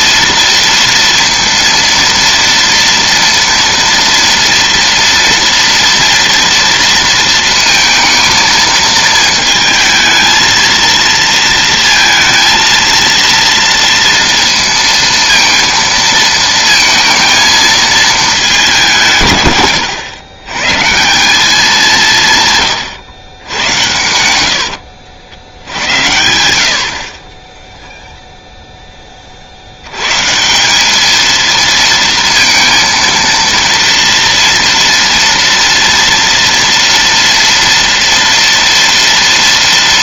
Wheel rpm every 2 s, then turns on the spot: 230, 230, 230, 230, 230, 230, 230, 230, 230, 210, 120, 120, 100, 80, 0, 160, 230, 230, 230, 230.
24-26